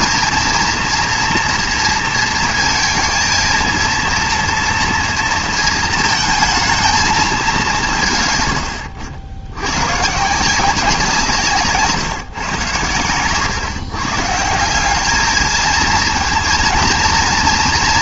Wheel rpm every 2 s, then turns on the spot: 230, 230, 230, 220, 110, 170, 120, 170, 230.
none